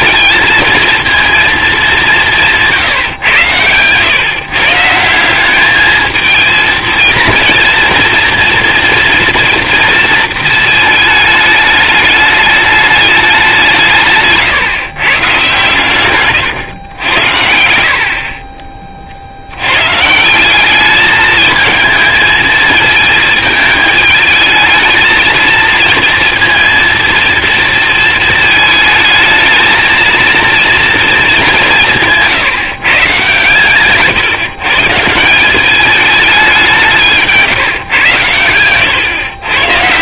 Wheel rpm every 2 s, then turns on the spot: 230, 130, 170, 230, 240, 220, 200, 140, 90, 50, 210, 220, 220, 230, 220, 220, 140, 160, 180, 120.
none